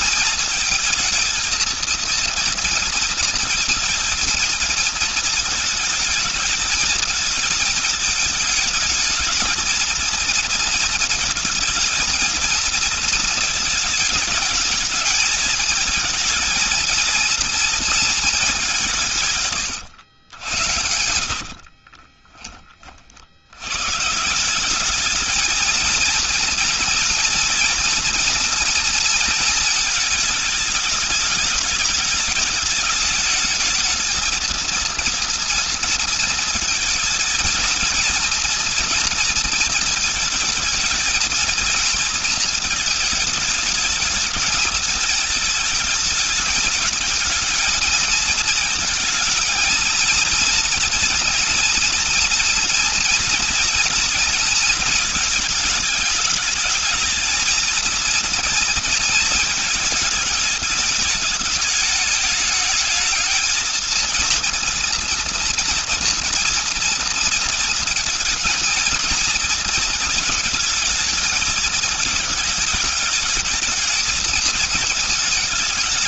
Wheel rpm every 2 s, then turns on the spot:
230, 230, 230, 220, 210, 230, 220, 210, 230, 180, 90, 40, 200, 230, 230, 220, 210, 230, 220, 230, 220, 220, 220, 220, 220, 230, 230, 220, 210, 230, 220, 210, 230, 230, 220, 220, 220, 220.
20-22